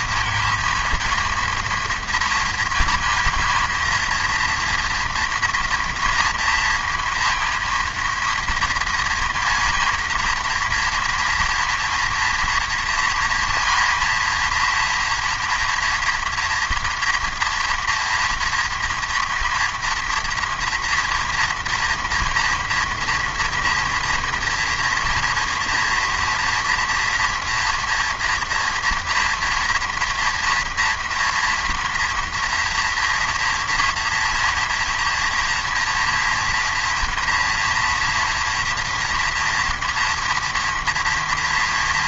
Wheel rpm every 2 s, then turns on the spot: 230, 230, 230, 230, 230, 230, 230, 230, 230, 230, 230, 230, 240, 230, 240, 230, 230, 230, 230, 230, 230.
none